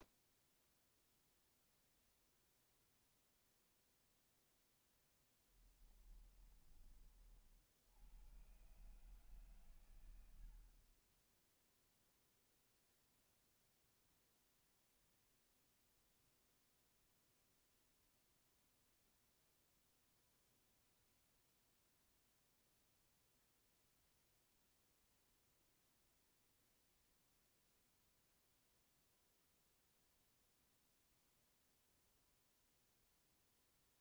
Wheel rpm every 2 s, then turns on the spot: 0, 0, 0, 20, 110, 50, 0, 0, 0, 0, 0, 0, 0, 0, 0, 0, 0.
none